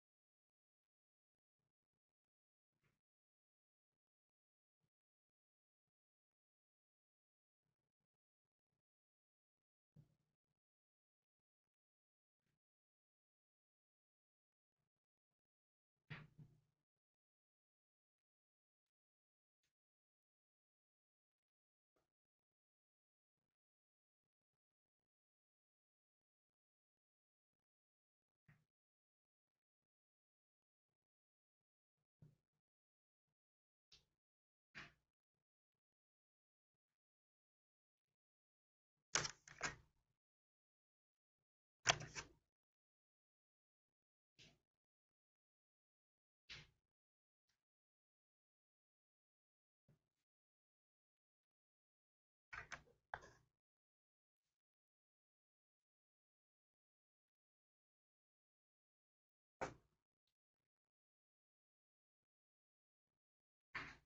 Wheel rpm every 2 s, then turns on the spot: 0, 0, 0, 0, 0, 0, 0, 0, 0, 0, 0, 0, 0, 0, 0, 0, 0, 0, 0, 0, 0, 0, 0, 0, 0, 0, 0, 0, 0, 0, 0, 0.
none